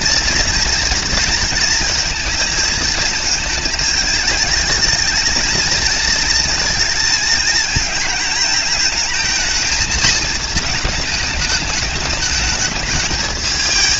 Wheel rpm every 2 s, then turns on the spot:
240, 220, 220, 230, 220, 220, 220.
none